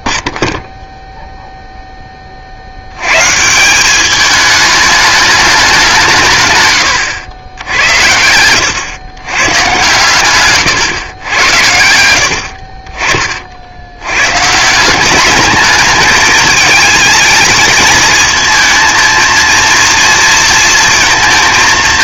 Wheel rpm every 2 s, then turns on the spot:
0, 70, 210, 130, 110, 120, 40, 160, 220, 220, 230.
8-10